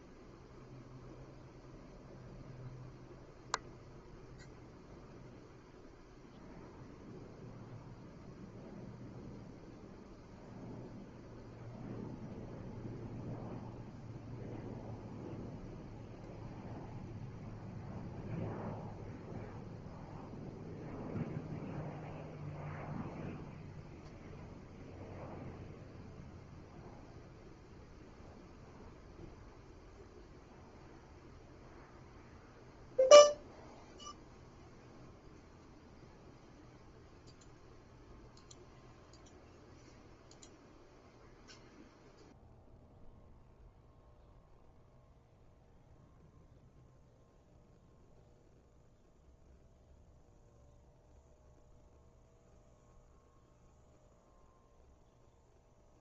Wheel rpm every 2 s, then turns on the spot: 0, 0, 0, 0, 0, 0, 0, 0, 0, 0, 0, 0, 0, 0, 0, 0, 0, 0, 0, 0, 0, 0, 0, 0, 0, 0, 0, 0.
none